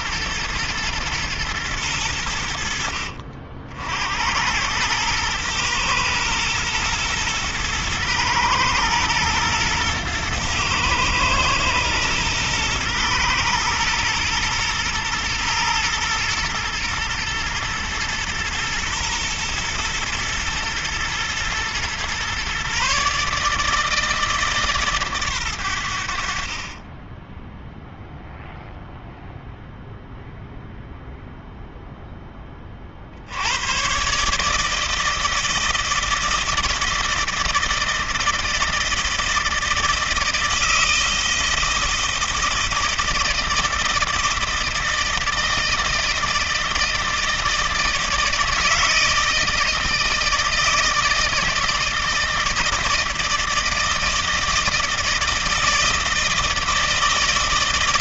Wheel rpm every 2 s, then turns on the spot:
120, 90, 90, 120, 110, 110, 110, 120, 110, 110, 120, 130, 150, 40, 0, 0, 20, 150, 160, 160, 160, 160, 160, 160, 160, 160, 160, 160, 160.
none